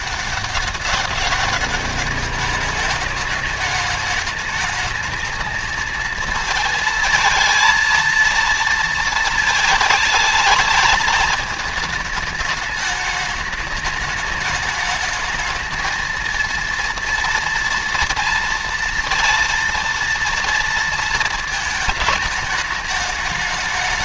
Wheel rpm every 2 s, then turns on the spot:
200, 210, 220, 220, 220, 210, 210, 210, 230, 230, 230, 220.
none